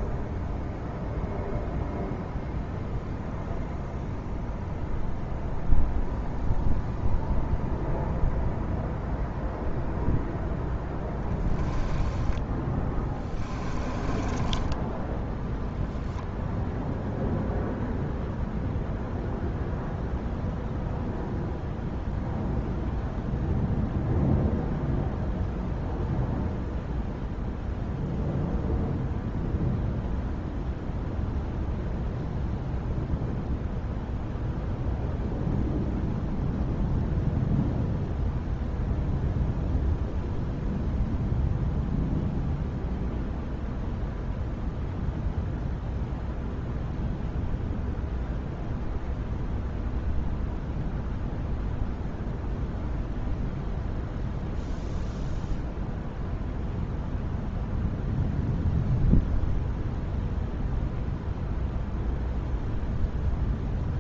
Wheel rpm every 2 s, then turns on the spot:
0, 0, 0, 0, 0, 0, 10, 10, 0, 0, 0, 0, 0, 0, 0, 0, 0, 0, 0, 0, 0, 0, 0, 0, 0, 0, 0, 0, 0, 0, 0, 0.
12-16